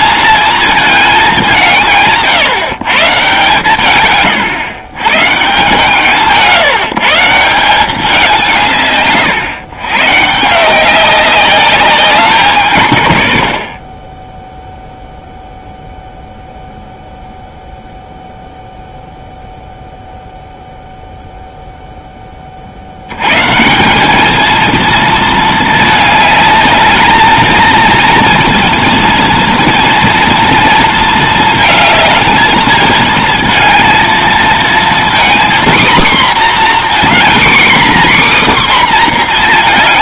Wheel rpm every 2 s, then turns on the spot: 230, 150, 120, 160, 140, 180, 140, 0, 0, 0, 0, 70, 230, 210, 230, 230, 220, 230, 250, 260.
none